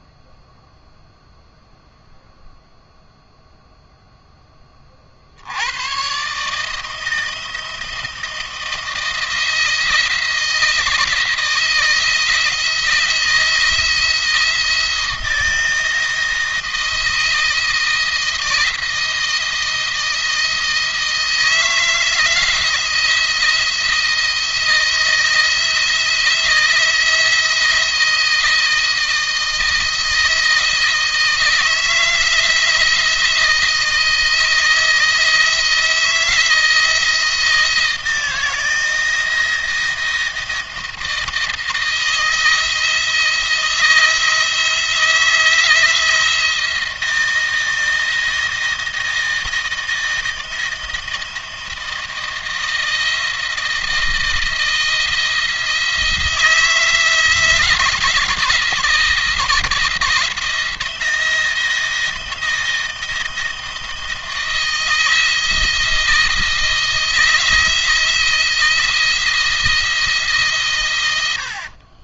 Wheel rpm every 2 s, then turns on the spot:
0, 0, 20, 150, 170, 160, 170, 170, 160, 170, 160, 170, 160, 160, 160, 160, 170, 160, 160, 160, 160, 160, 170, 160, 160, 160, 160, 160, 160, 160, 160, 170, 160, 160, 170, 130.
none